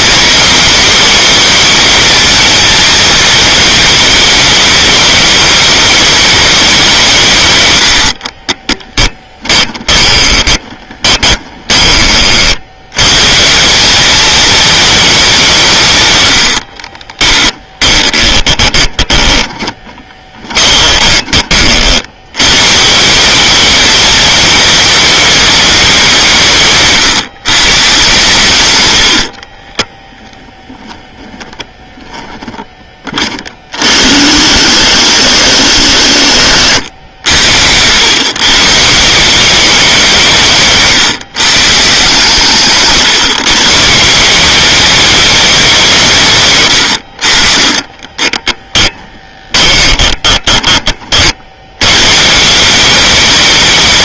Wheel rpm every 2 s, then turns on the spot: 230, 230, 200, 200, 30, 20, 70, 220, 90, 20, 20, 130, 230, 150, 130, 10, 10, 90, 80, 140, 160, 140, 180, 130, 10, 20, 170.
8-12 18-22 36-38 48-52